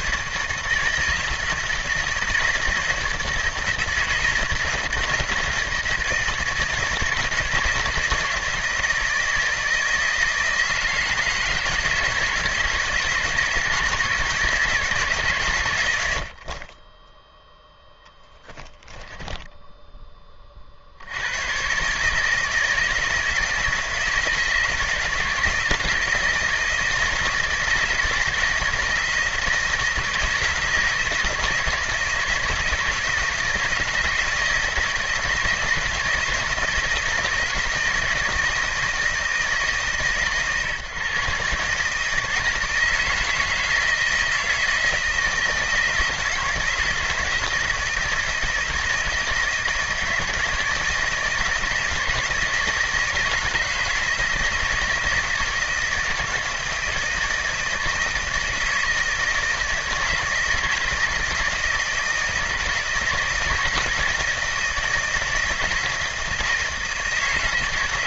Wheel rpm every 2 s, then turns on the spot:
160, 160, 160, 160, 160, 160, 160, 160, 20, 10, 50, 160, 160, 160, 160, 160, 160, 160, 160, 160, 130, 160, 160, 160, 160, 160, 160, 160, 160, 160, 170, 160, 170, 160.
18-20